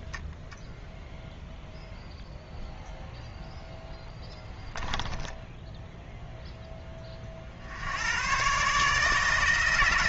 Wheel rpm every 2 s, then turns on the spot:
0, 0, 10, 10, 130.
4-6